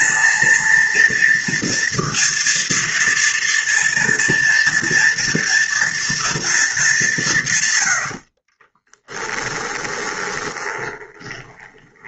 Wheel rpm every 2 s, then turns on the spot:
230, 230, 240, 220, 30, 20.
8-12